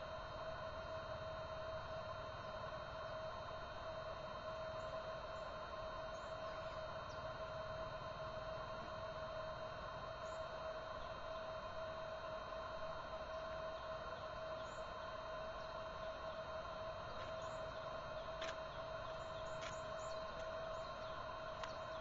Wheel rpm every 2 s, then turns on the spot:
0, 0, 0, 0, 0, 0, 0, 0, 0, 0, 0.
none